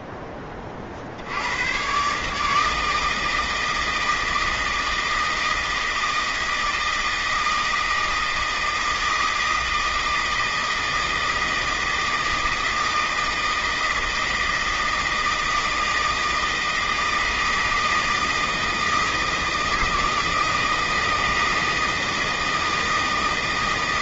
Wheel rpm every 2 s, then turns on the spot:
40, 150, 160, 160, 160, 160, 160, 160, 160, 160, 160, 160.
none